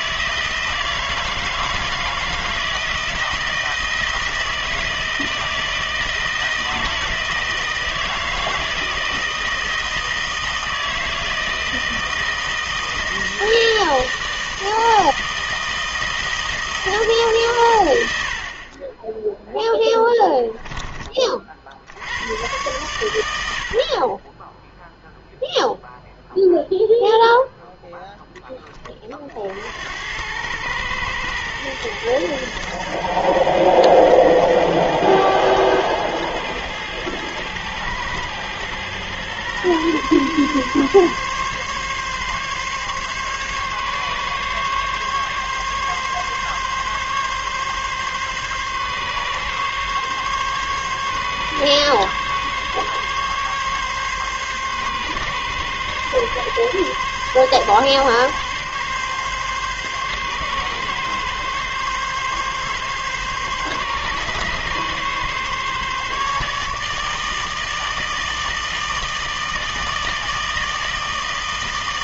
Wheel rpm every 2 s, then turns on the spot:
160, 170, 160, 160, 160, 160, 160, 160, 160, 30, 10, 100, 0, 0, 20, 100, 110, 110, 110, 120, 140, 140, 140, 140, 140, 140, 140, 140, 140, 140, 140, 140, 140, 150, 160, 160.
none